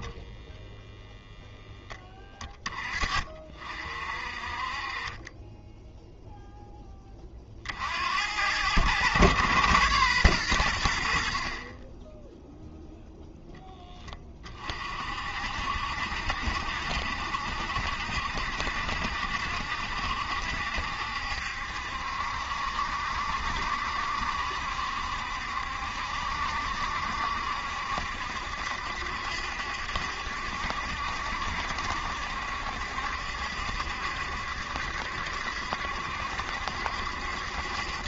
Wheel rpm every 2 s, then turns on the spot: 10, 20, 40, 10, 100, 110, 0, 30, 70, 70, 70, 70, 70, 70, 70, 70, 70, 70, 70.
none